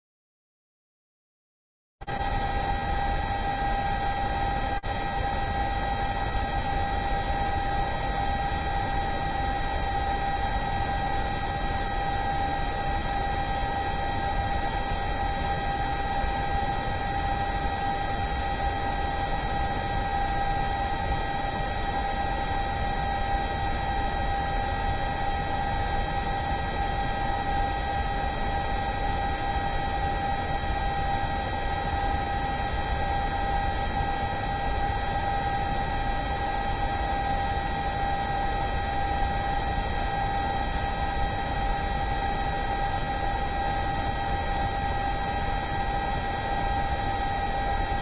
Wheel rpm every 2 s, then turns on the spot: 0, 0, 0, 0, 0, 0, 0, 0, 0, 0, 0, 0, 0, 0, 0, 0, 0, 0, 0, 0, 0, 0, 0, 0.
none